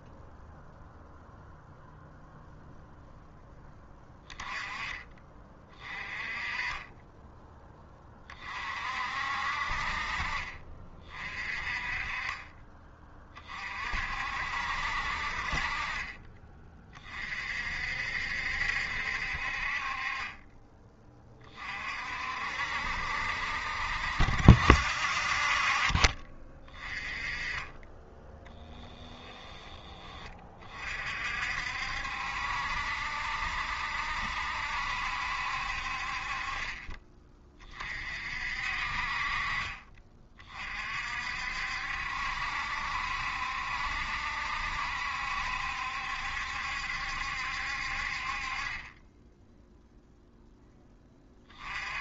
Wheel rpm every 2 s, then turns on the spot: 0, 0, 20, 20, 50, 40, 20, 60, 30, 70, 20, 60, 50, 20, 10, 40, 70, 70, 30, 50, 40, 70, 70, 70, 30, 10.
28-30